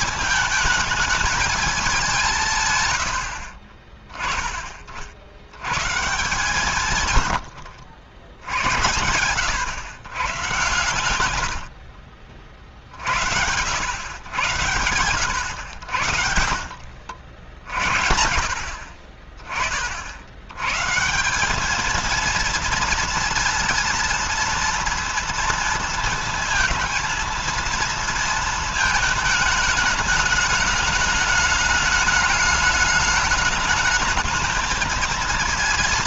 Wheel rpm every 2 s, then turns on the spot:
220, 160, 30, 160, 80, 110, 50, 110, 70, 50, 110, 230, 230, 230, 220, 210, 210, 220.
none